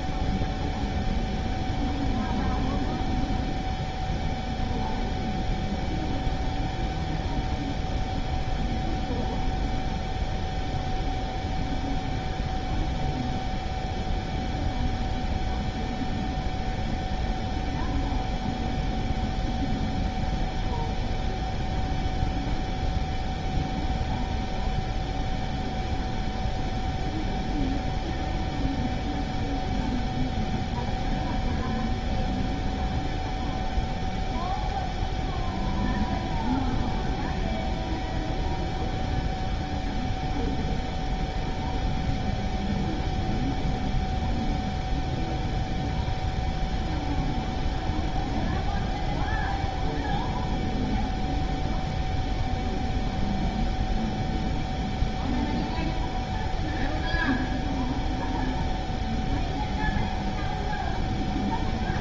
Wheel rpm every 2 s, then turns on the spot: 0, 0, 0, 0, 0, 0, 0, 0, 0, 0, 0, 0, 0, 0, 0, 0, 0, 0, 0, 0, 0, 0, 0, 0, 0, 0, 0, 0, 0, 0, 0.
none